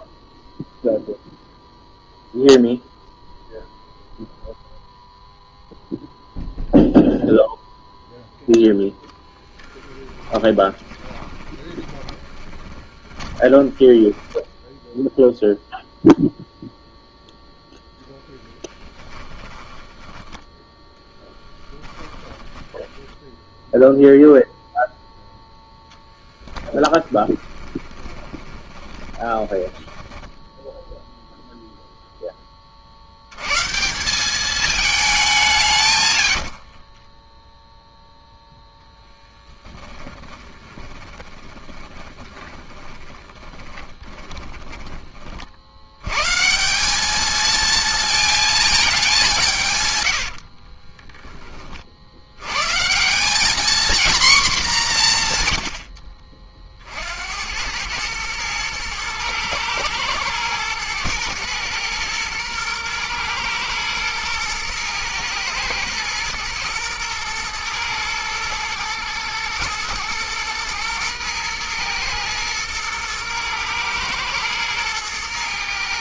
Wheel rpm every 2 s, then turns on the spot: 0, 0, 0, 0, 0, 10, 30, 10, 0, 10, 10, 10, 0, 10, 20, 10, 40, 210, 50, 0, 20, 20, 20, 160, 220, 40, 130, 220, 50, 110, 110, 110, 110, 120, 110, 120, 110, 110.
10-16 18-24 26-30 36-38 40-46 50-52